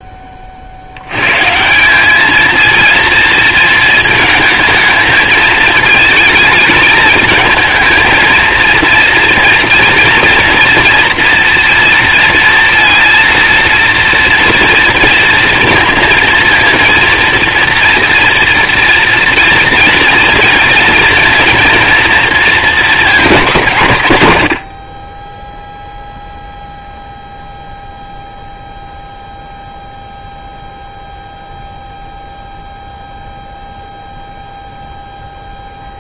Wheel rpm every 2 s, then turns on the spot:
140, 230, 220, 210, 230, 240, 230, 230, 240, 230, 230, 210, 10, 0, 0, 0, 0, 0.
none